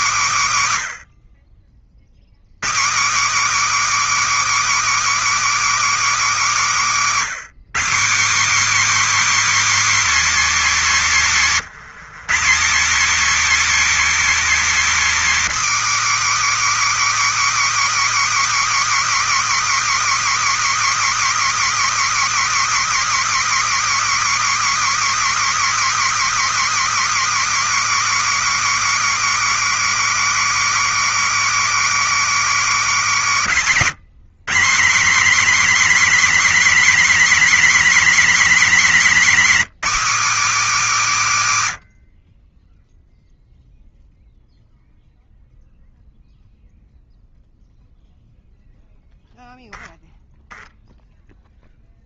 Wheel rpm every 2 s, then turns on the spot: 140, 180, 330, 270, 270, 250, 220, 270, 300, 300, 290, 290, 290, 290, 290, 290, 260, 200, 270, 260, 260, 10, 0, 0, 0, 0.
none